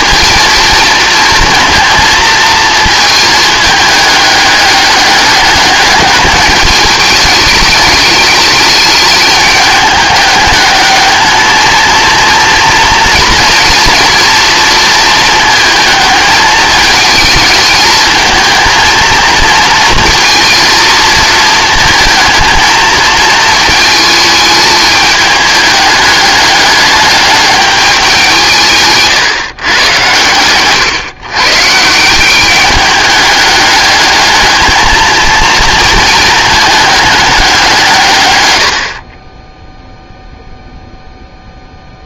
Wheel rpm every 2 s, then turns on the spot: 230, 220, 210, 220, 210, 210, 230, 230, 220, 220, 230, 220, 220, 210, 160, 120, 200, 220, 220, 90, 0.
none